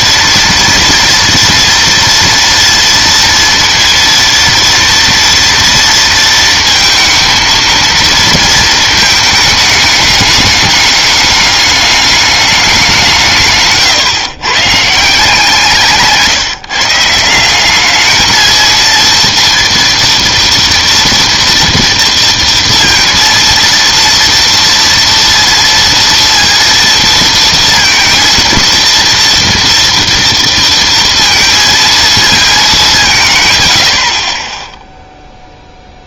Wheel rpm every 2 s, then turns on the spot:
230, 230, 230, 220, 220, 210, 200, 130, 170, 220, 230, 230, 230, 230, 230, 230, 210, 10.
none